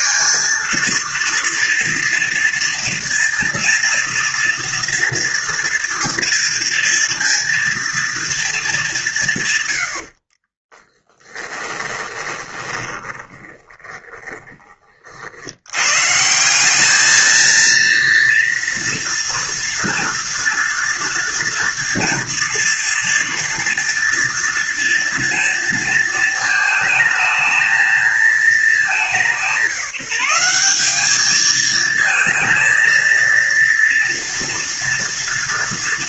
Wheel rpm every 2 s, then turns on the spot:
230, 230, 230, 230, 190, 20, 20, 40, 210, 230, 230, 240, 230, 220, 200, 200, 230, 230.
10-14